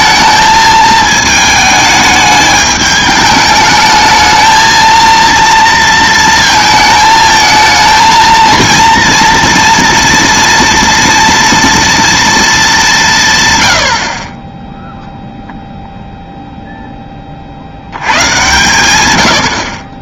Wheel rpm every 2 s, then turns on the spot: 220, 210, 220, 220, 230, 230, 210, 10, 0, 120.
none